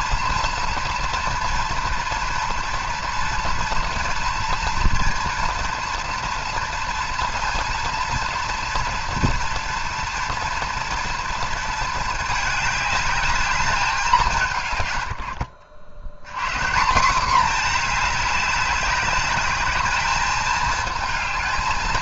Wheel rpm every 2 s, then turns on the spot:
230, 230, 230, 230, 240, 240, 210, 150, 170, 200, 220.
none